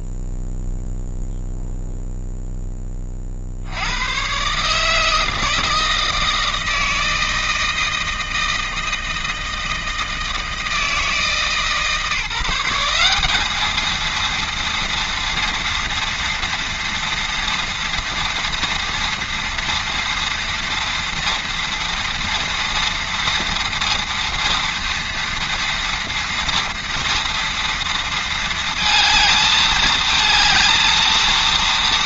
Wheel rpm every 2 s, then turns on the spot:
0, 0, 110, 160, 160, 160, 170, 230, 230, 230, 230, 230, 230, 230, 230, 220.
none